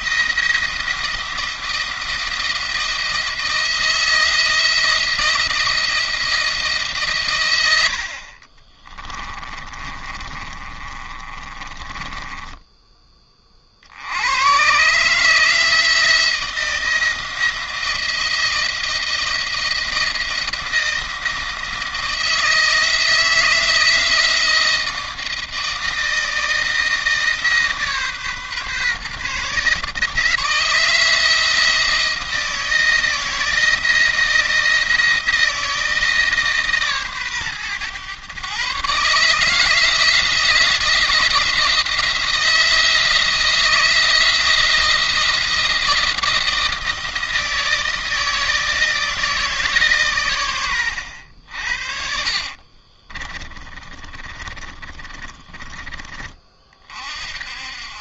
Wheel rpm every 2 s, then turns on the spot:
170, 170, 170, 160, 30, 50, 20, 120, 170, 170, 170, 170, 160, 160, 140, 160, 160, 170, 150, 140, 170, 160, 160, 170, 160, 110, 40, 20, 40.
8-12 52-56